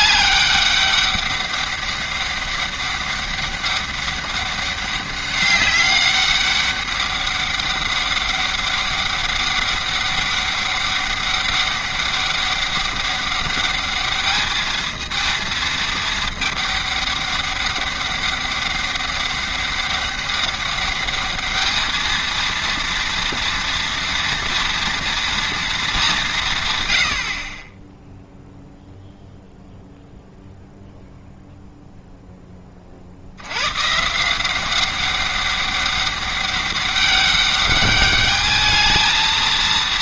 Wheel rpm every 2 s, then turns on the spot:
200, 200, 200, 200, 200, 200, 200, 220, 210, 200, 200, 230, 230, 140, 0, 0, 20, 180, 200, 210.
none